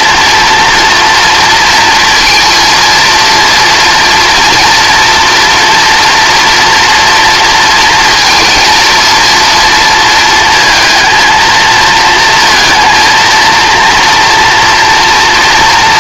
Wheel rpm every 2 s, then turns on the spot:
230, 230, 230, 230, 230, 220, 230, 230.
none